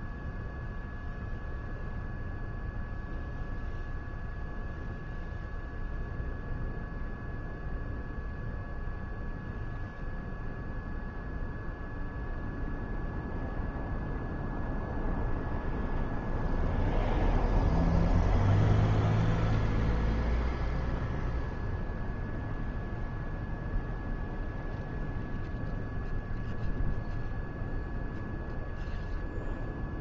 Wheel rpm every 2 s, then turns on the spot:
0, 0, 0, 0, 0, 0, 0, 0, 0, 0, 0, 0, 0, 0, 0.
none